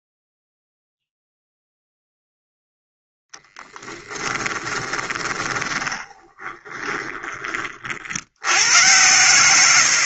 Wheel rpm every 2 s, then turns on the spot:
0, 0, 20, 20, 80.
4-8